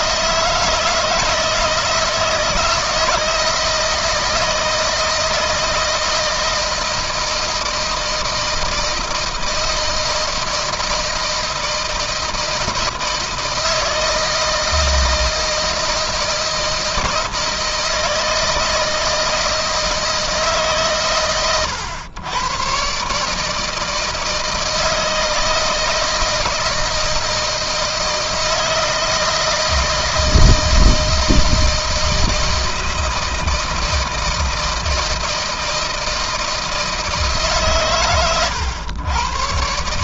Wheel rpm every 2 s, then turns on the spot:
160, 160, 160, 160, 160, 160, 160, 160, 160, 160, 150, 120, 160, 160, 160, 160, 160, 160, 160, 120.
none